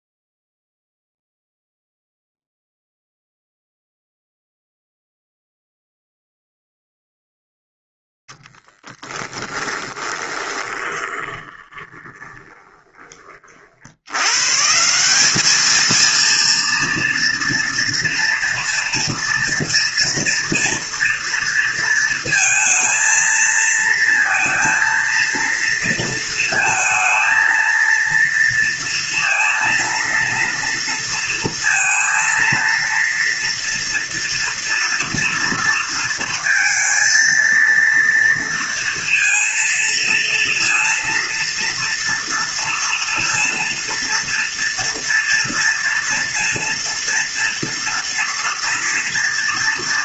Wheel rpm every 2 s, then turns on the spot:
0, 0, 0, 0, 10, 20, 20, 160, 230, 240, 240, 230, 230, 230, 230, 230, 230, 230, 230, 230, 230, 230, 230, 230, 230.
8-14